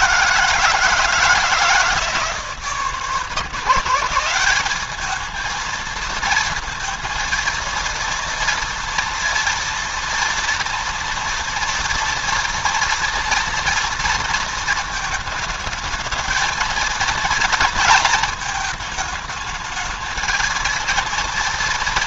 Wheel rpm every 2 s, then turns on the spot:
160, 160, 210, 230, 230, 230, 230, 220, 230, 220, 230.
none